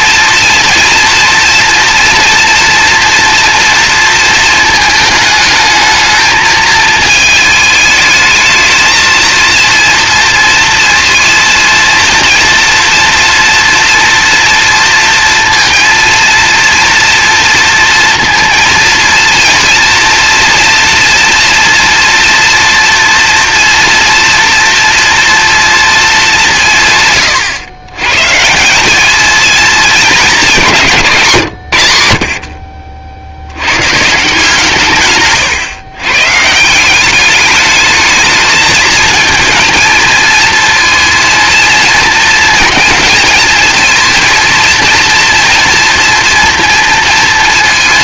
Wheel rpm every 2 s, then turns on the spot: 230, 230, 220, 220, 220, 230, 230, 230, 240, 230, 230, 230, 230, 150, 180, 190, 50, 150, 180, 220, 230, 230, 230, 230.
none